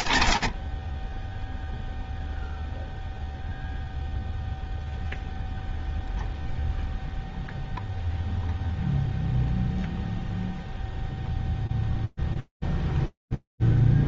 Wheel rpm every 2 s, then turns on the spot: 60, 0, 0, 0, 0, 0, 0.
none